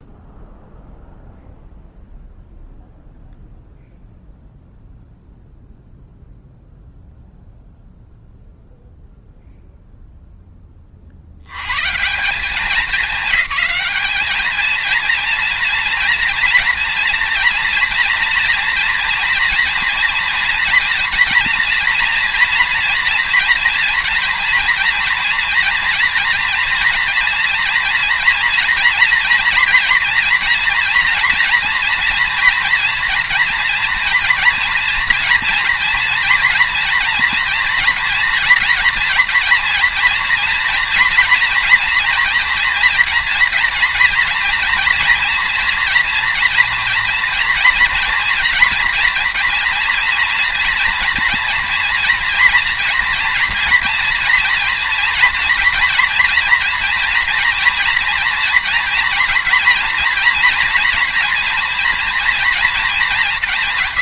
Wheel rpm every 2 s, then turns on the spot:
0, 0, 0, 0, 0, 10, 200, 230, 230, 230, 230, 240, 230, 240, 230, 230, 230, 230, 240, 230, 230, 230, 240, 230, 230, 230, 240, 230, 230, 240, 240, 230.
none